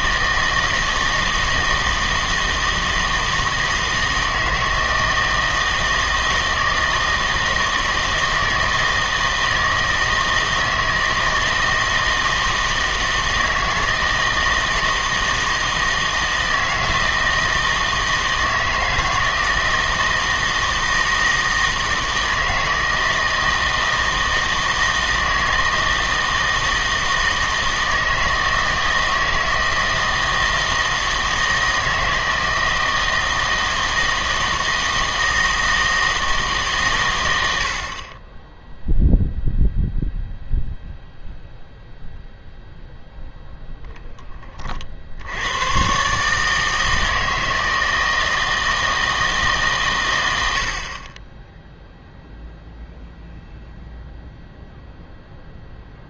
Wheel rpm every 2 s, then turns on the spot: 160, 160, 160, 160, 160, 160, 160, 160, 160, 160, 160, 160, 160, 160, 160, 160, 160, 160, 140, 0, 0, 0, 40, 160, 160, 60, 0, 0.
none